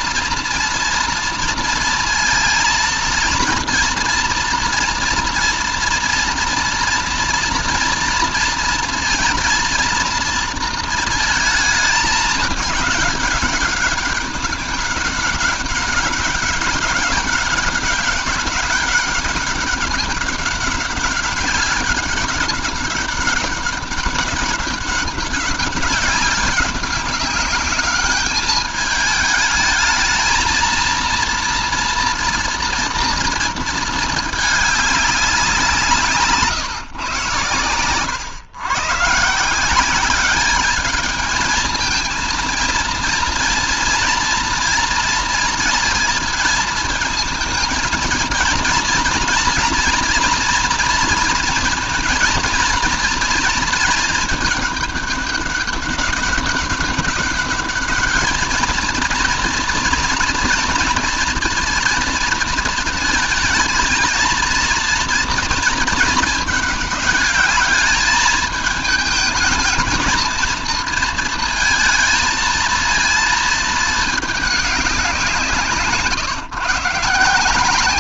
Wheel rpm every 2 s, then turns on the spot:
230, 230, 230, 230, 230, 230, 210, 200, 200, 200, 200, 200, 200, 190, 210, 230, 240, 210, 150, 140, 210, 230, 230, 230, 220, 230, 230, 210, 190, 220, 230, 230, 230, 220, 210, 230, 230, 200, 130.
none